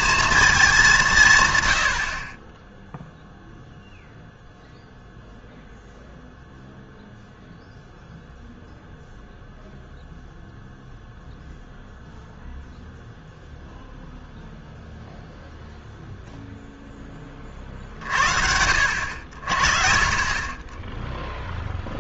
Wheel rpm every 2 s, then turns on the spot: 200, 10, 0, 0, 0, 0, 0, 0, 0, 60, 10.
none